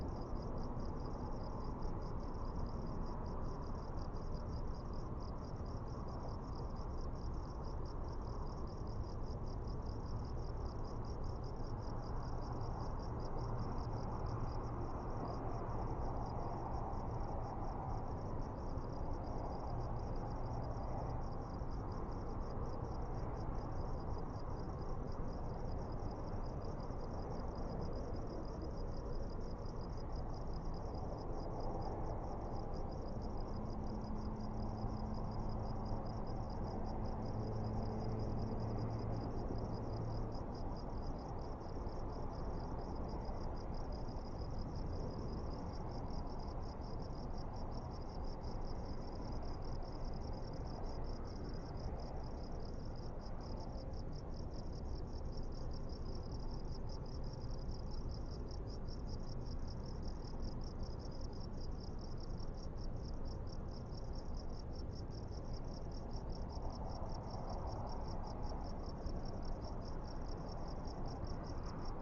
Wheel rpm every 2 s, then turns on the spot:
0, 0, 0, 0, 0, 0, 0, 0, 0, 0, 0, 0, 0, 0, 0, 0, 0, 0, 0, 0, 0, 0, 0, 0, 0, 0, 0, 0, 0, 0, 0, 0, 0, 0, 0, 0.
none